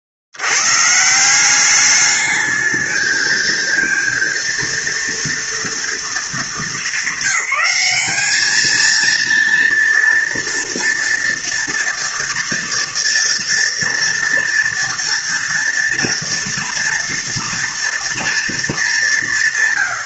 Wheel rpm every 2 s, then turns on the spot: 50, 210, 230, 210, 210, 230, 230, 240, 230, 220.
none